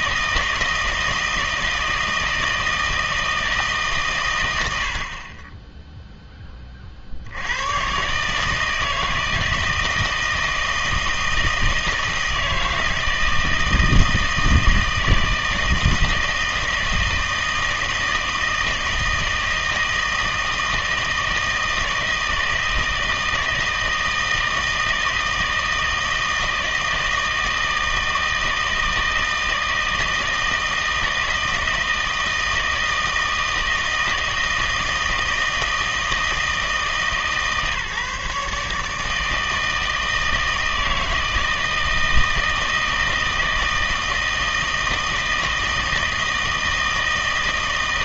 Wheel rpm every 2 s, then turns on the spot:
160, 160, 90, 30, 160, 160, 160, 160, 160, 160, 160, 160, 160, 160, 160, 160, 160, 160, 150, 150, 160, 160, 160, 160.
none